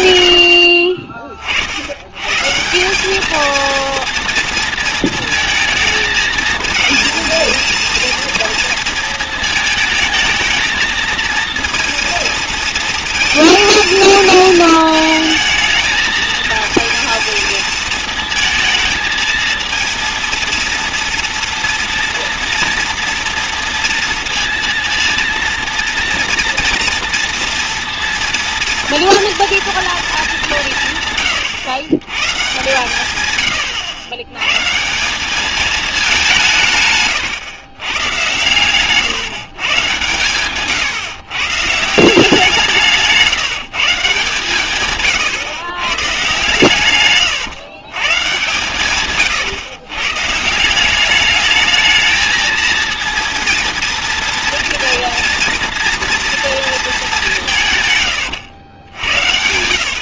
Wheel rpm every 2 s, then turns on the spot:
60, 160, 230, 220, 230, 230, 220, 220, 230, 220, 230, 230, 230, 230, 230, 170, 140, 140, 150, 120, 130, 170, 140, 120, 130, 170, 230, 240, 230, 100.
38-40 58-60